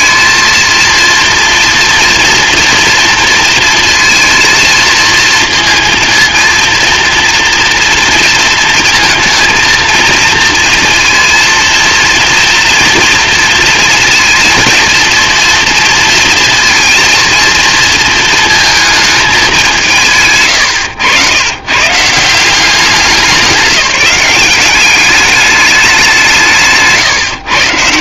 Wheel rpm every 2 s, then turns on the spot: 230, 230, 230, 230, 230, 230, 230, 230, 230, 220, 100, 190, 200, 140.
none